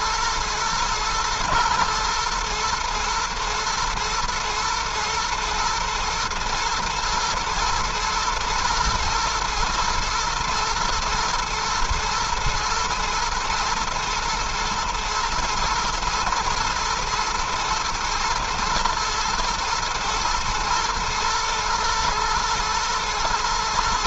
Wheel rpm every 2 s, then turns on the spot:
120, 120, 110, 110, 110, 110, 110, 120, 110, 120, 120, 110.
none